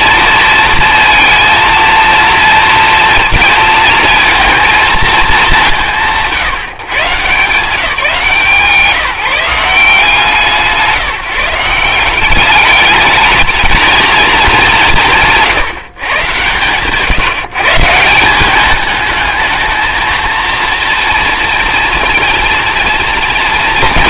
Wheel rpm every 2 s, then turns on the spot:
230, 230, 220, 140, 160, 150, 200, 200, 120, 210, 230, 230.
none